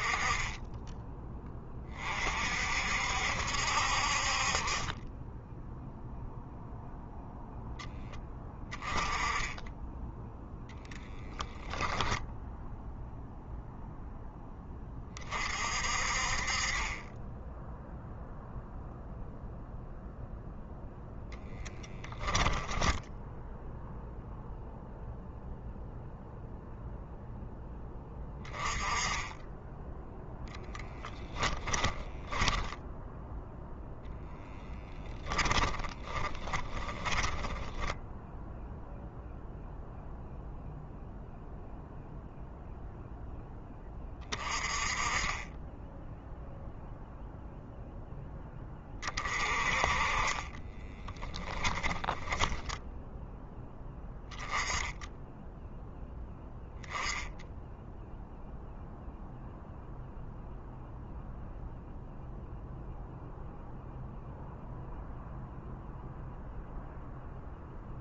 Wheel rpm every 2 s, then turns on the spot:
20, 60, 20, 0, 20, 10, 0, 30, 30, 0, 0, 10, 0, 0, 10, 10, 10, 10, 30, 0, 0, 0, 30, 0, 20, 20, 10, 10, 10, 0, 0, 0, 0, 0.
10-12 22-24 30-32 34-38 50-52